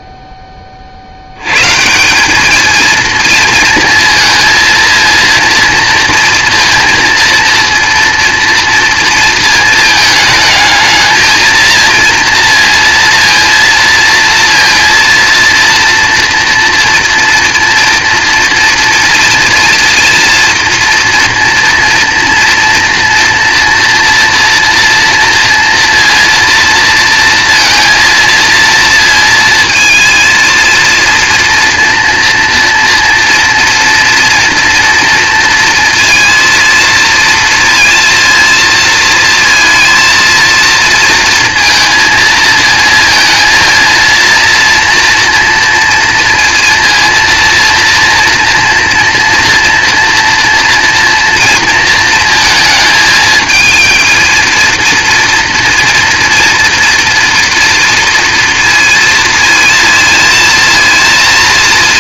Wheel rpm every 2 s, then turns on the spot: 70, 230, 230, 230, 230, 220, 230, 230, 240, 230, 230, 230, 230, 230, 230, 230, 230, 230, 230, 230, 230, 230, 240, 230, 230, 230, 220, 230, 230, 230, 230.
none